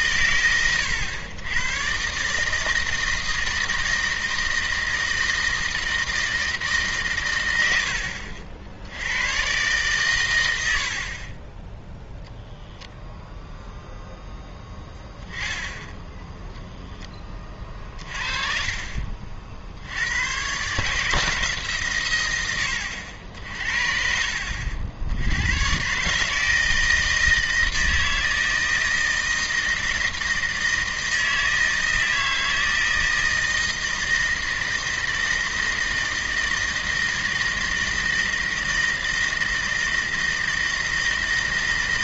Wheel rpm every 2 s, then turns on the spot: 110, 160, 160, 150, 80, 80, 0, 0, 10, 40, 140, 90, 70, 160, 160, 160, 160, 160, 160, 160, 160.
none